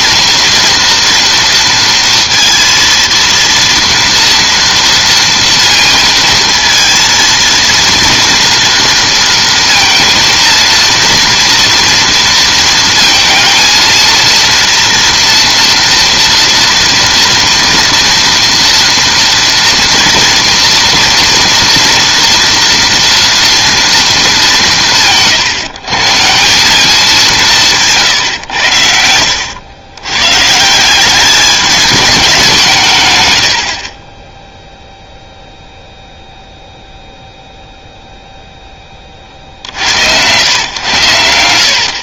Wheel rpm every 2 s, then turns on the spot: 230, 230, 230, 230, 230, 230, 230, 230, 230, 230, 230, 230, 200, 180, 100, 160, 170, 0, 0, 0, 110.
none